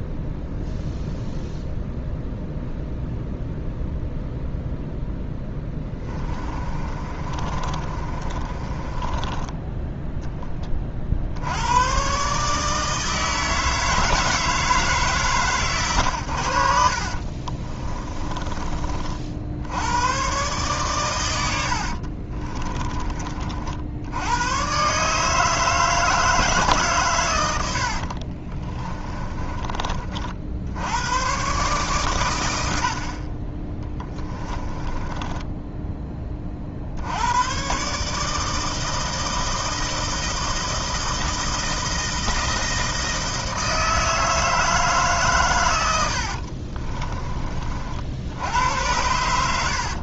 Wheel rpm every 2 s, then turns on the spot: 0, 0, 0, 30, 20, 40, 160, 150, 60, 40, 120, 20, 130, 150, 30, 80, 80, 20, 60, 160, 160, 160, 150, 30, 80.
6-10 22-24 28-30 34-36 46-48